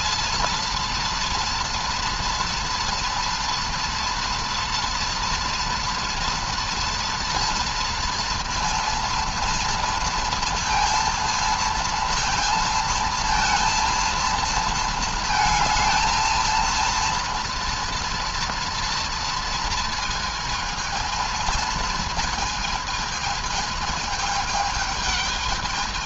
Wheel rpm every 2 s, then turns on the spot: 230, 230, 240, 240, 230, 230, 230, 230, 230, 230, 220, 220, 220.
none